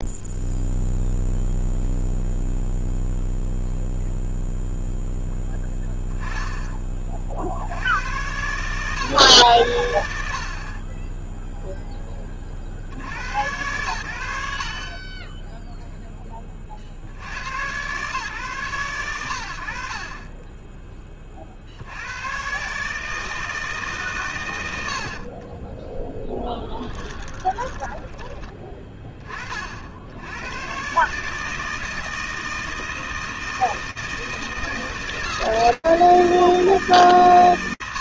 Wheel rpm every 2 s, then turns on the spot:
0, 0, 0, 20, 120, 30, 50, 70, 50, 110, 20, 140, 90, 10, 10, 110, 160, 160, 150.
26-28